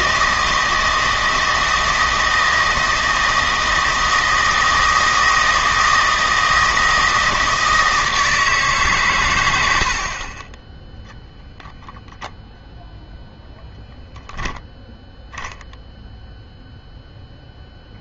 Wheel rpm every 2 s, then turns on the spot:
160, 160, 160, 160, 140, 10, 0, 0, 0.
none